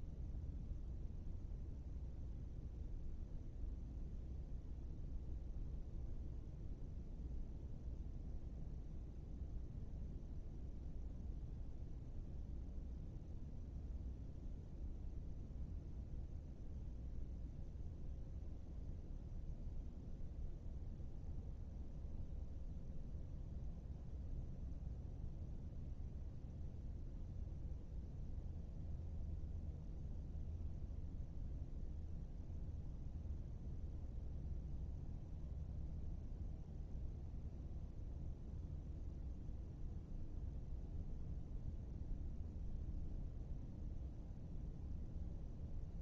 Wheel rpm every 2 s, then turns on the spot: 0, 0, 0, 0, 0, 0, 0, 0, 0, 0, 0, 0, 0, 0, 0, 0, 0, 0, 0, 0, 0, 0, 0.
none